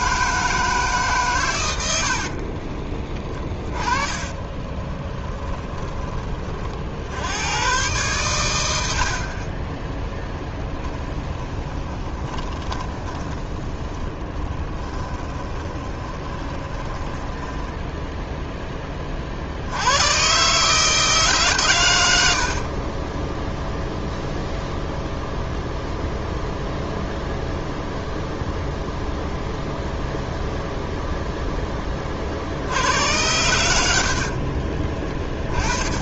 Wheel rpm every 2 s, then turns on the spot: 150, 20, 20, 60, 70, 10, 10, 20, 10, 20, 150, 30, 0, 0, 0, 0, 80, 30.
2-6 10-12 14-18 22-24 34-36